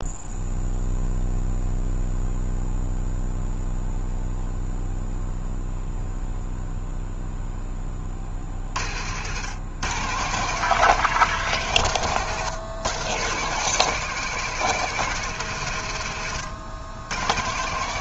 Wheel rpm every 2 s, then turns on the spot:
0, 0, 0, 0, 60, 150, 120, 160, 100.
none